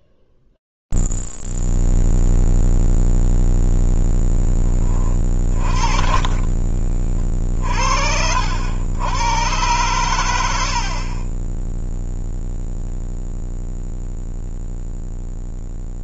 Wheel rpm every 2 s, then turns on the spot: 0, 0, 10, 40, 70, 110, 0, 0.
6-8